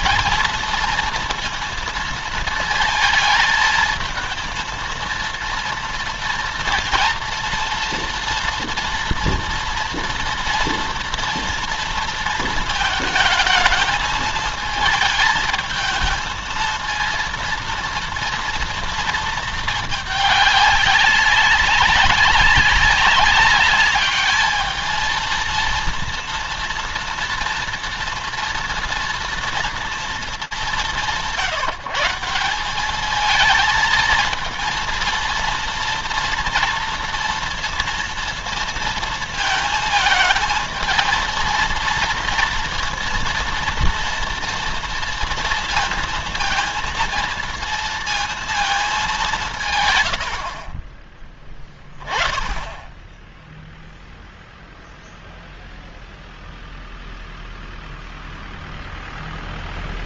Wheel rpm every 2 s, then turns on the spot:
230, 220, 230, 230, 230, 240, 220, 220, 230, 230, 200, 200, 220, 230, 230, 190, 200, 230, 230, 230, 220, 230, 230, 230, 210, 40, 10, 0, 0, 0.
50-52